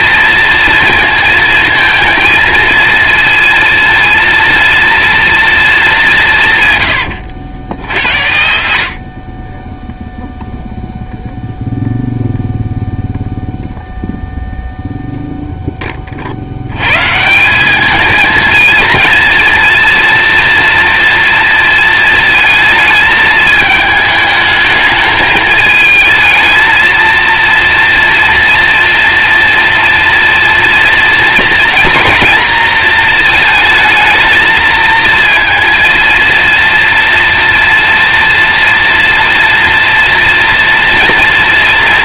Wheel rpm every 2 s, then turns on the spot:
230, 220, 230, 190, 80, 0, 0, 0, 50, 220, 230, 230, 220, 220, 230, 230, 230, 220, 230, 240, 230.
none